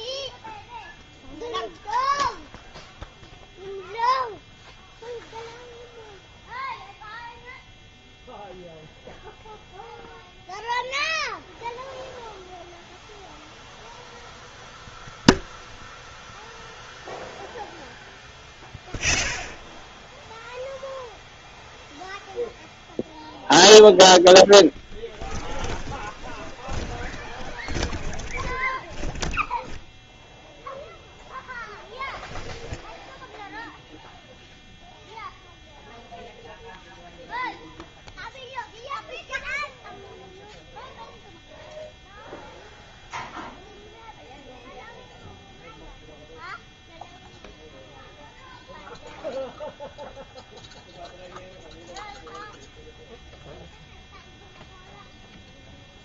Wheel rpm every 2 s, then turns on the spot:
0, 0, 0, 0, 0, 0, 0, 0, 0, 0, 0, 0, 20, 20, 10, 0, 0, 0, 0, 0, 0, 0, 0, 0, 0, 0, 0, 0.
24-30